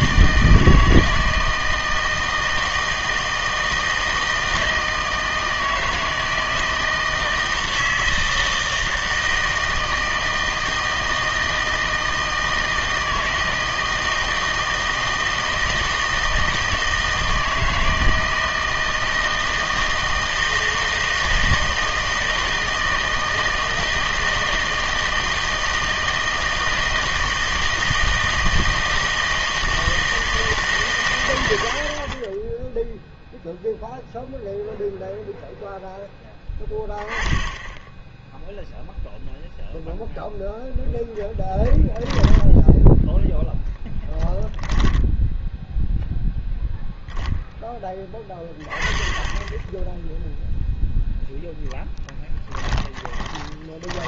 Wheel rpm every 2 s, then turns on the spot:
160, 160, 160, 160, 160, 160, 160, 160, 160, 160, 160, 160, 160, 160, 160, 150, 10, 0, 10, 0, 0, 10, 10, 0, 20, 0, 10.
42-46 52-54